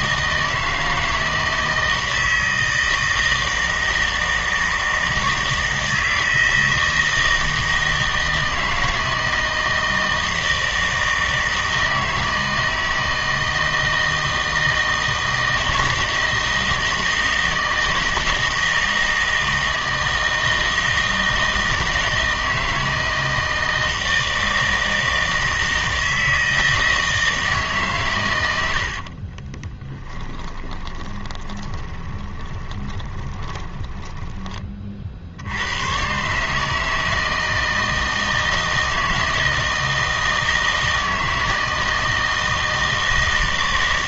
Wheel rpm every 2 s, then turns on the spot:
160, 160, 160, 160, 160, 160, 160, 160, 160, 160, 160, 160, 160, 160, 80, 20, 20, 20, 150, 160, 160, 160.
30-34